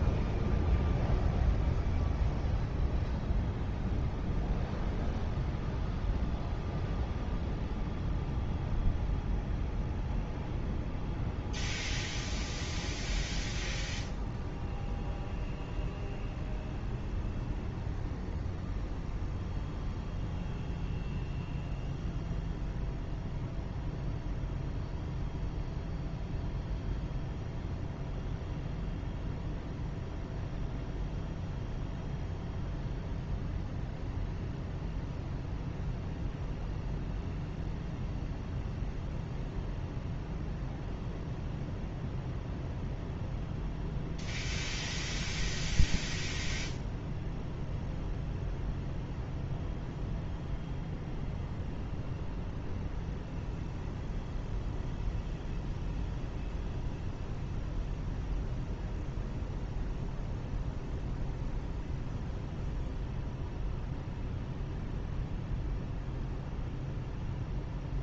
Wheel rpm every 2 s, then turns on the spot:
0, 0, 0, 0, 0, 0, 0, 0, 0, 0, 0, 0, 0, 0, 0, 0, 0, 0, 0, 0, 0, 0, 0, 0, 0, 0, 0, 0, 0, 0, 0, 0, 0, 0.
none